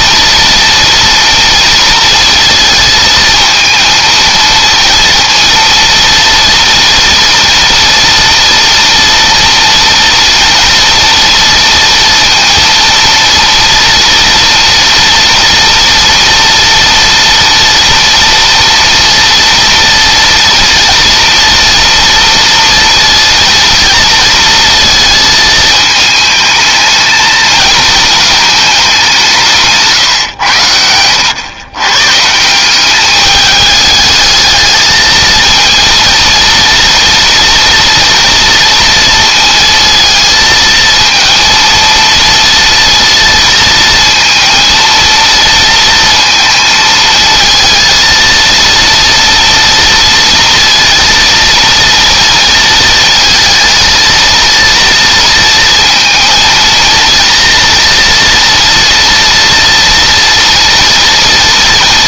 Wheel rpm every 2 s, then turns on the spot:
230, 230, 230, 230, 230, 230, 230, 230, 230, 230, 230, 230, 230, 220, 200, 90, 200, 220, 230, 230, 230, 230, 230, 230, 230, 230, 230, 230, 230, 230, 230.
none